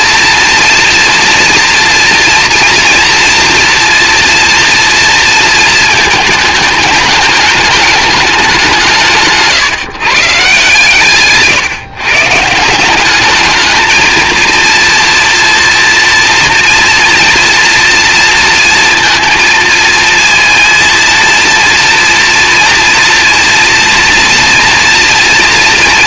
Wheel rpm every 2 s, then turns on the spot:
230, 230, 230, 210, 180, 150, 170, 230, 230, 230, 230, 230, 240.
none